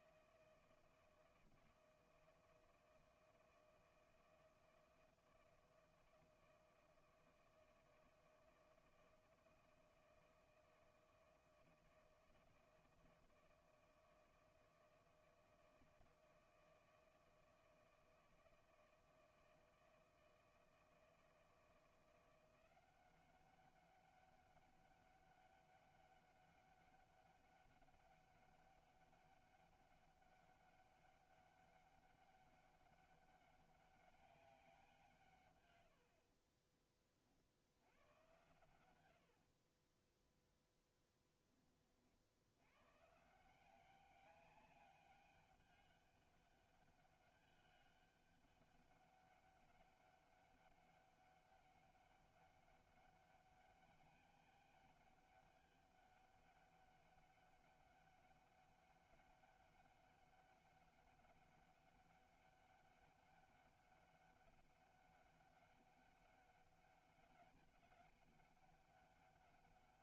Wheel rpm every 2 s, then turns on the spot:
160, 160, 160, 160, 160, 160, 160, 160, 160, 160, 160, 180, 200, 200, 200, 200, 200, 180, 20, 120, 0, 100, 200, 200, 200, 200, 200, 200, 200, 200, 200, 200, 200, 200, 200.
36-38